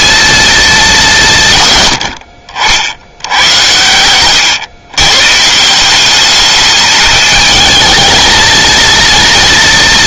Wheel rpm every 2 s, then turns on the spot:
190, 80, 130, 210, 230.
none